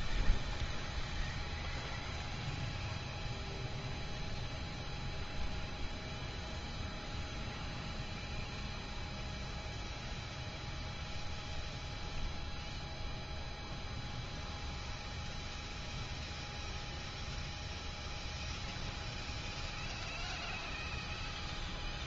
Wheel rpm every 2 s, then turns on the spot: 0, 0, 0, 0, 0, 0, 0, 0, 0, 0, 0.
none